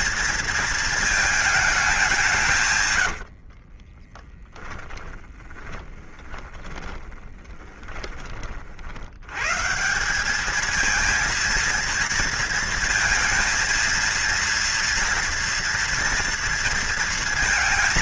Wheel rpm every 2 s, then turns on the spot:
230, 150, 10, 20, 40, 210, 230, 230, 230.
4-8